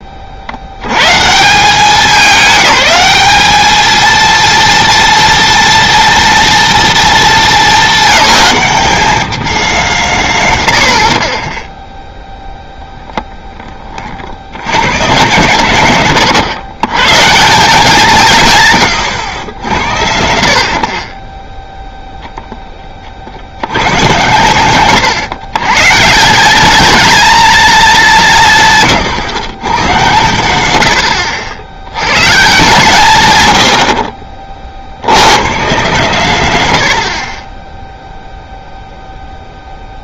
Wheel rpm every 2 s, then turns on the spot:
60, 200, 230, 240, 210, 130, 10, 120, 130, 170, 90, 10, 120, 200, 160, 110, 170, 50, 130, 0.
none